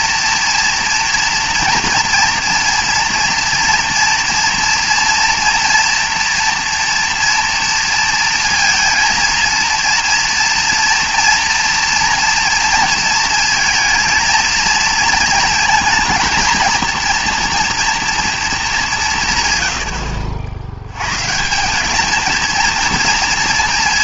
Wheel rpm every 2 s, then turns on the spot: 230, 230, 230, 240, 230, 230, 230, 220, 230, 200, 90, 230.
none